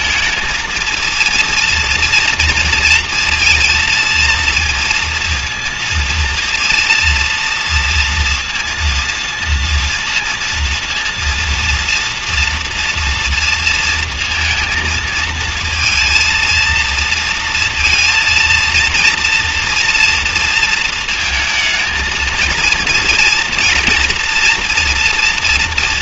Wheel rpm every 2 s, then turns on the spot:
230, 230, 230, 230, 230, 230, 230, 230, 230, 230, 230, 230, 230.
none